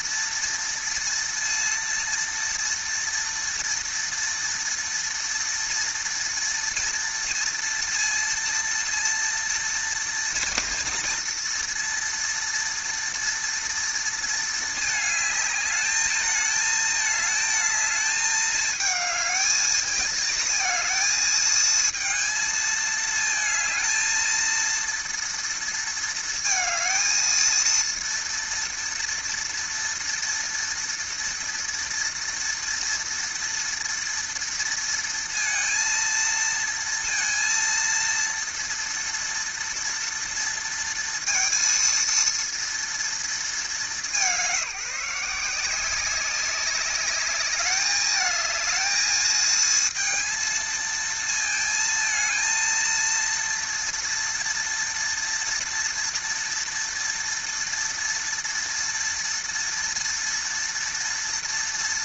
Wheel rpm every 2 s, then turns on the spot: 230, 230, 230, 230, 230, 230, 230, 220, 220, 220, 220, 220, 230, 220, 230, 230, 230, 230, 230, 230, 230, 230, 190, 190, 220, 230, 220, 230, 230, 230, 230.
none